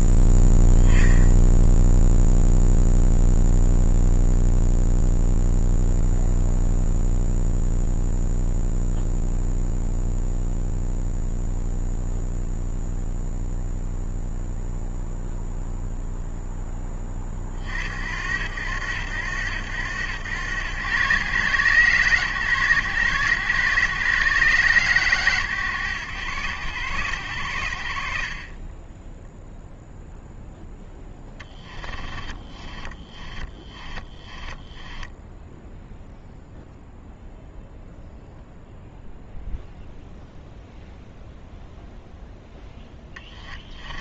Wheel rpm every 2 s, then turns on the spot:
30, 0, 0, 0, 0, 0, 0, 0, 10, 80, 80, 80, 90, 60, 0, 10, 20, 10, 0, 0, 0, 10.
30-36 42-44